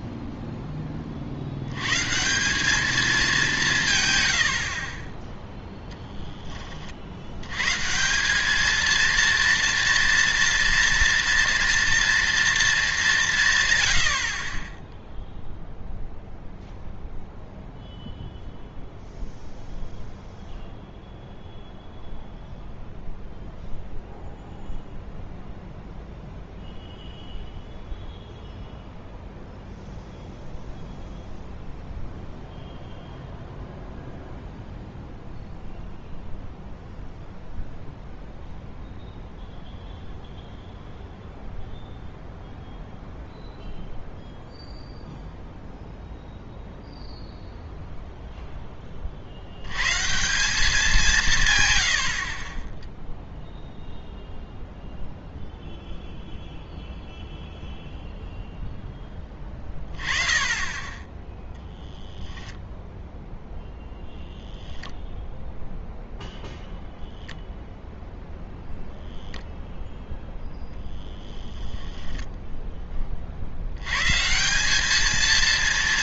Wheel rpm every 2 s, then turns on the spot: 10, 200, 70, 30, 220, 230, 220, 10, 0, 0, 0, 0, 0, 0, 0, 0, 0, 0, 0, 0, 0, 0, 0, 0, 10, 190, 10, 0, 0, 0, 20, 0, 0, 0, 0, 0, 10, 200.
none